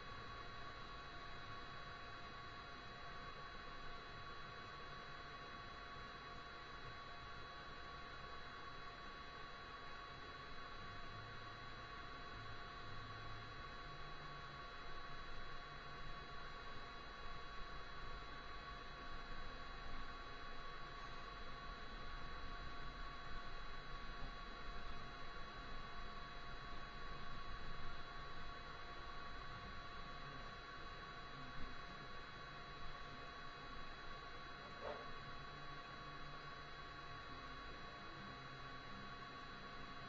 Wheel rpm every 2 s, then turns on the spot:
0, 0, 0, 0, 0, 0, 0, 0, 0, 0, 0, 0, 0, 0, 0, 0, 0, 0, 0, 0.
none